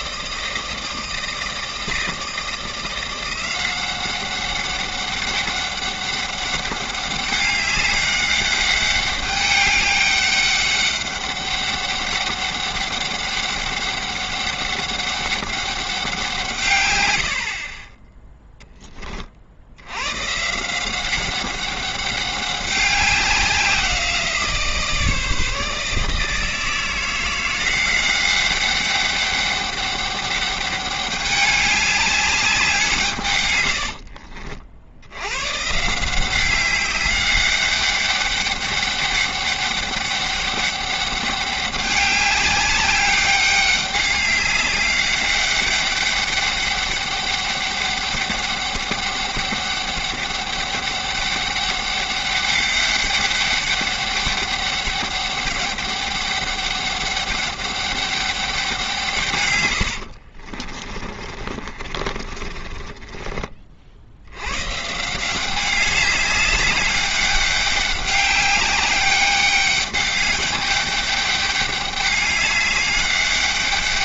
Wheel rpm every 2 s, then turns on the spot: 160, 170, 200, 200, 200, 200, 200, 200, 140, 10, 170, 190, 160, 170, 200, 200, 180, 60, 190, 200, 200, 200, 200, 200, 200, 200, 200, 200, 200, 180, 40, 30, 130, 200, 200, 200, 200.
60-64